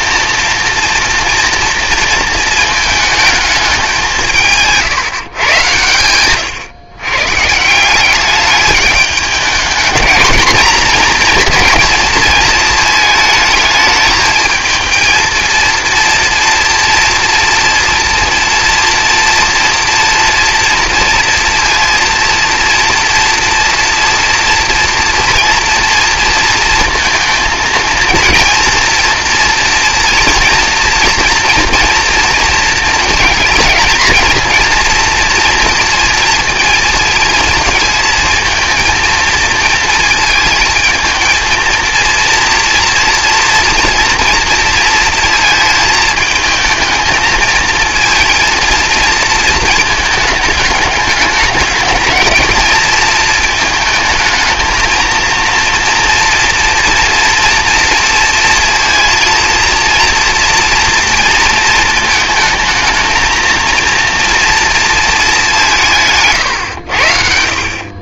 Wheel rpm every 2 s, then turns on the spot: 230, 220, 150, 140, 210, 230, 220, 230, 240, 230, 240, 230, 230, 220, 230, 230, 230, 230, 230, 230, 220, 230, 230, 220, 230, 210, 230, 230, 230, 230, 230, 220, 230, 100.
none